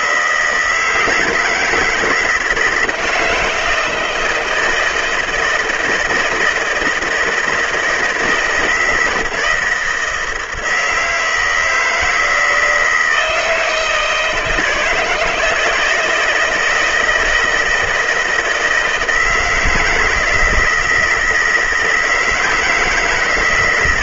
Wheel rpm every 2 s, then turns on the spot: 160, 170, 160, 160, 160, 160, 160, 160, 160, 160, 160, 160.
none